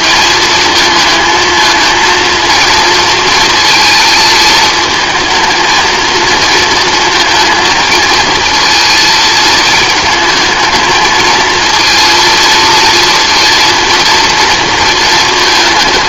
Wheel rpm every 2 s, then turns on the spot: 220, 230, 220, 230, 220, 220, 230, 230.
none